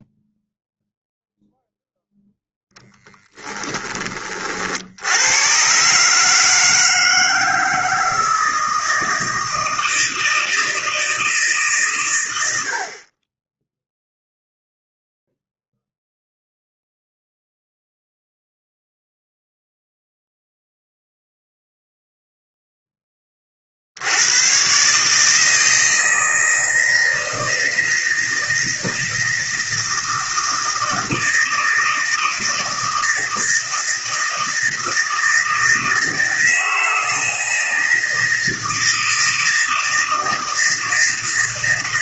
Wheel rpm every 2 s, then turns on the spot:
0, 0, 60, 160, 160, 160, 70, 0, 0, 0, 0, 0, 130, 160, 160, 160, 160, 160, 160, 160, 160.
none